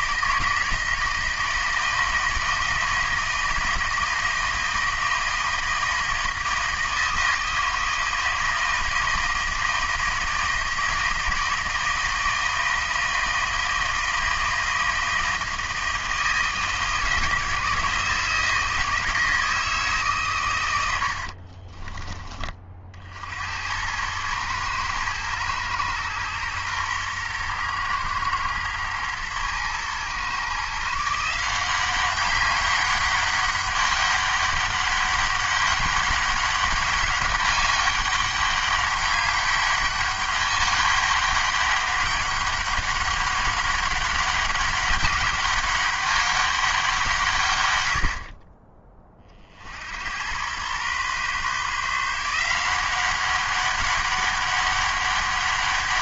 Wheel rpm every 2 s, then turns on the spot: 160, 160, 160, 160, 160, 160, 160, 160, 160, 160, 100, 40, 110, 120, 120, 140, 200, 200, 200, 200, 200, 200, 200, 190, 30, 110, 170, 200.
none